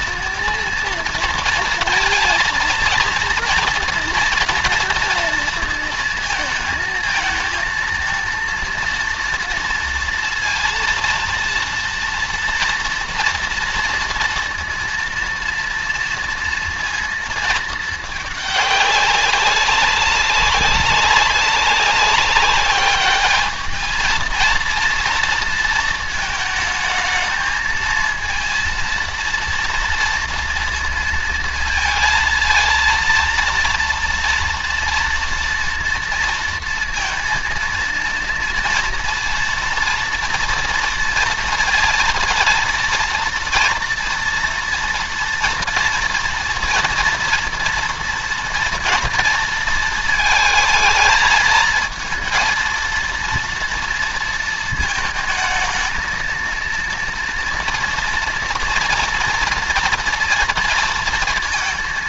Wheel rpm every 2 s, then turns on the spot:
230, 230, 230, 220, 230, 230, 230, 230, 230, 200, 200, 210, 230, 220, 230, 230, 230, 230, 230, 230, 230, 230, 230, 230, 230, 220, 230, 220, 230, 230, 230.
none